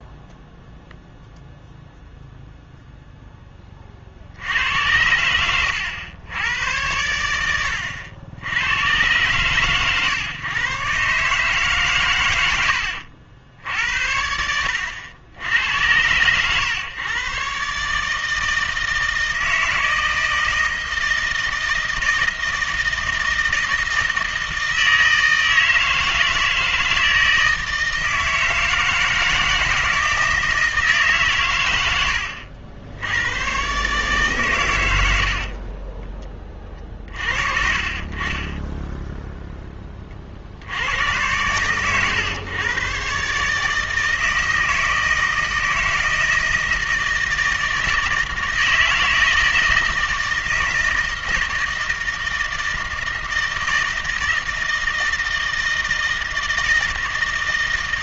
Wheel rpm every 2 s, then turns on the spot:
0, 0, 90, 100, 110, 130, 80, 80, 120, 160, 160, 160, 160, 160, 160, 160, 70, 100, 30, 10, 90, 130, 160, 160, 160, 160, 160, 160, 160.
none